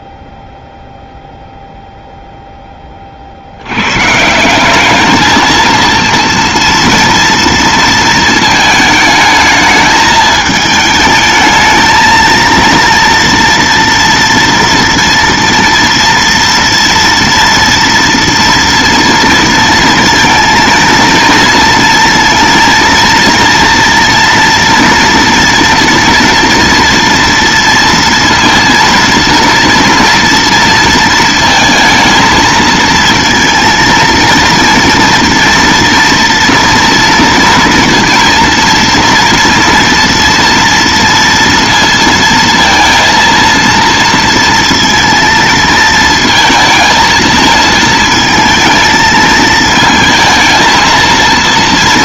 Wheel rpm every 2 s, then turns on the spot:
0, 40, 210, 230, 220, 220, 230, 230, 230, 230, 230, 230, 230, 230, 230, 230, 230, 230, 230, 230, 230, 230, 230, 220, 220, 230.
none